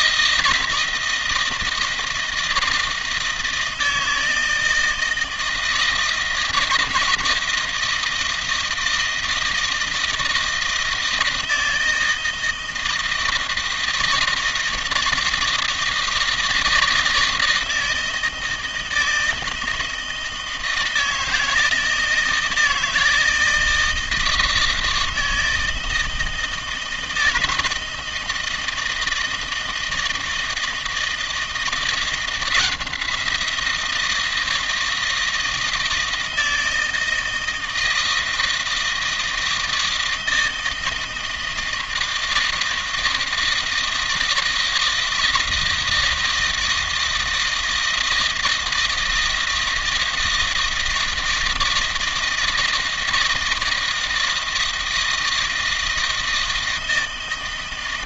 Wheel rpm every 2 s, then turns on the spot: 160, 160, 160, 160, 160, 160, 160, 160, 170, 160, 160, 160, 160, 160, 160, 160, 170, 160, 160, 160, 160, 160, 160, 160, 160, 160, 160, 160, 160.
none